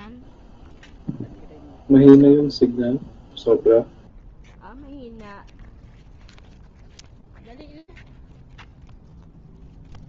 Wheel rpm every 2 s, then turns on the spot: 0, 0, 0, 0, 0.
none